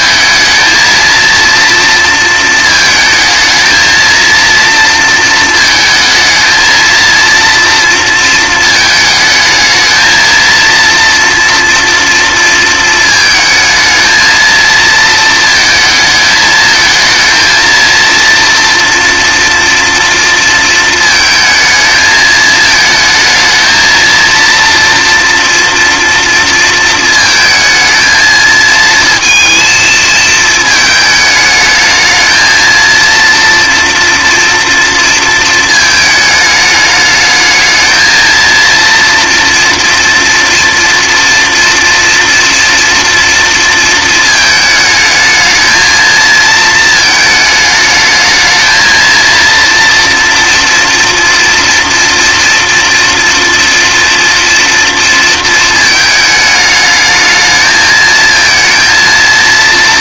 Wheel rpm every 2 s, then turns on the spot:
220, 220, 230, 230, 220, 230, 230, 220, 220, 230, 220, 220, 240, 230, 230, 220, 230, 230, 210, 230, 230, 240, 220, 220, 220, 230, 230, 240, 210, 230.
none